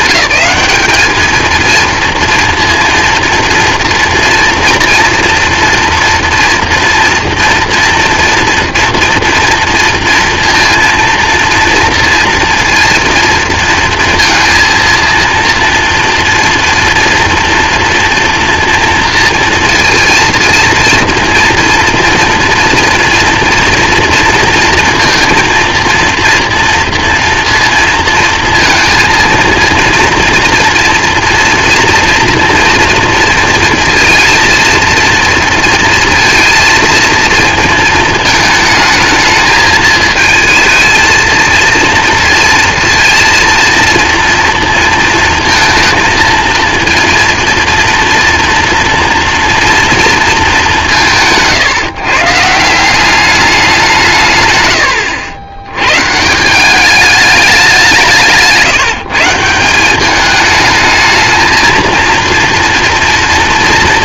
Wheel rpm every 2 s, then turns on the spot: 210, 230, 230, 230, 230, 230, 230, 230, 230, 230, 230, 230, 230, 230, 230, 230, 230, 230, 230, 220, 230, 230, 230, 230, 240, 160, 190, 100, 210, 170, 220, 230.
none